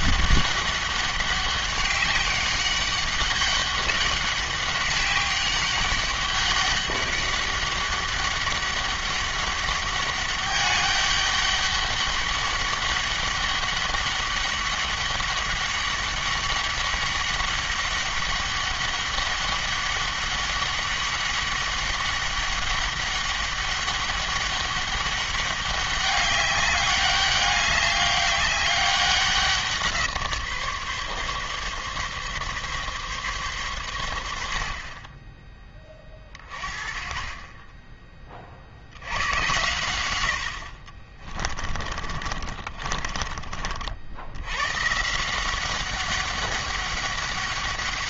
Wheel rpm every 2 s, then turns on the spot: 200, 200, 200, 200, 200, 200, 200, 200, 200, 200, 200, 200, 200, 200, 190, 140, 140, 50, 20, 70, 50, 40, 130, 200.
42-44